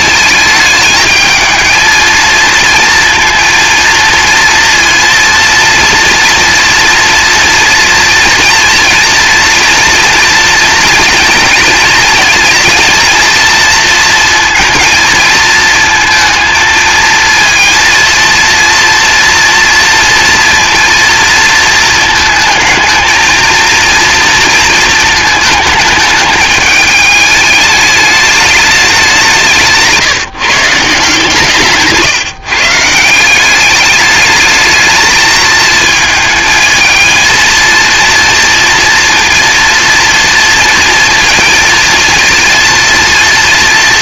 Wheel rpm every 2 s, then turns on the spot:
220, 230, 230, 230, 230, 230, 230, 230, 220, 240, 230, 230, 230, 210, 200, 160, 170, 220, 230, 230, 230, 230.
none